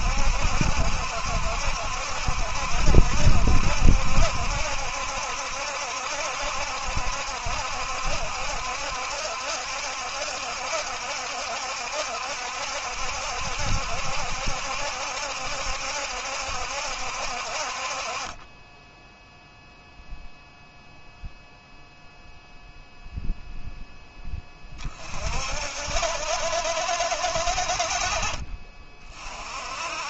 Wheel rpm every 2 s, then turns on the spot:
70, 70, 70, 70, 70, 70, 70, 70, 60, 0, 0, 0, 40, 60, 30.
none